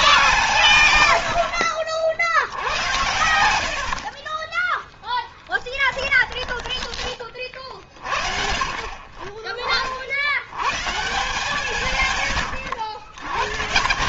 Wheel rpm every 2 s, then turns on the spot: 120, 80, 10, 10, 50, 130, 120.
0-8